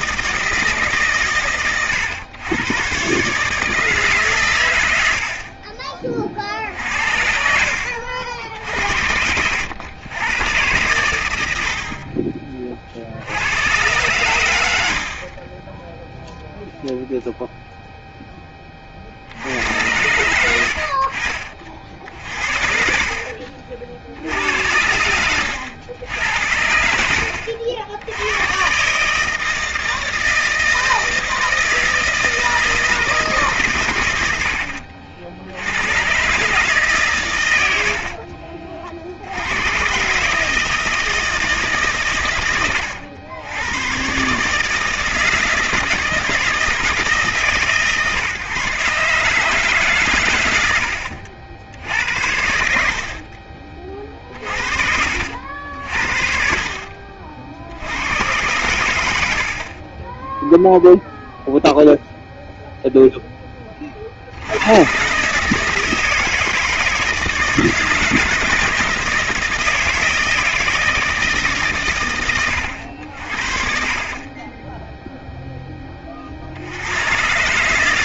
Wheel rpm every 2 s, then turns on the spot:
150, 130, 100, 60, 70, 110, 40, 80, 0, 30, 70, 50, 90, 70, 130, 160, 160, 70, 140, 50, 160, 100, 160, 160, 140, 100, 70, 60, 60, 100, 0, 0, 100, 160, 170, 160, 80, 10, 80.
52-58